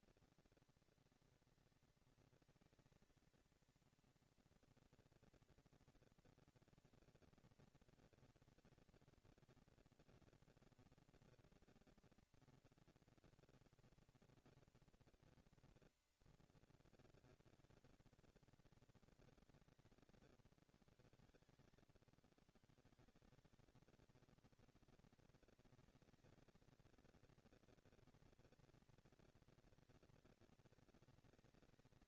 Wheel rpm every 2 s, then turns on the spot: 230, 230, 230, 230, 230, 230, 230, 230, 220, 190, 110, 160, 230, 230, 230, 230.
none